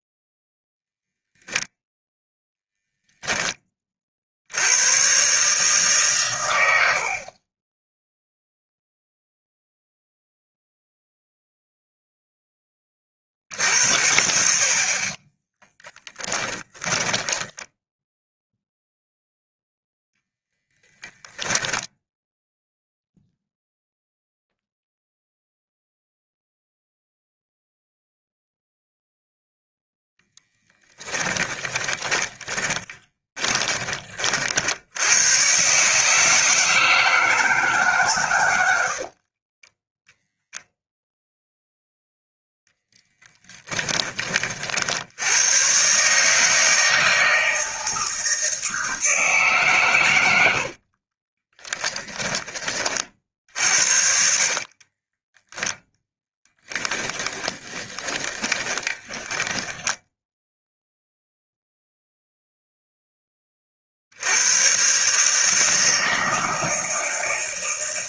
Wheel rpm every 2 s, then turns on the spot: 0, 0, 100, 70, 0, 0, 20, 40, 10, 0, 20, 0, 0, 0, 0, 10, 20, 70, 160, 80, 0, 10, 60, 160, 160, 60, 40, 30, 10, 20, 0, 0, 120, 160.
16-18 20-22 30-34 38-40 50-52 54-60